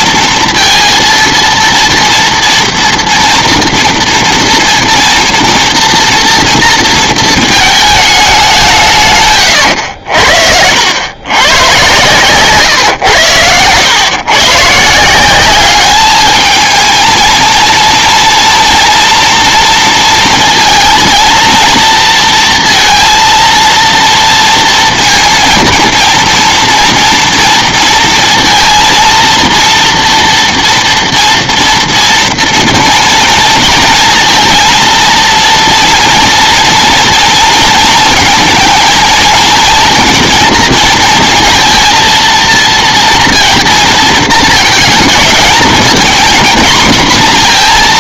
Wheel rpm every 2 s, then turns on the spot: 230, 230, 230, 230, 180, 70, 130, 140, 220, 230, 230, 230, 230, 230, 230, 240, 230, 230, 230, 220, 230, 230, 220, 240.
none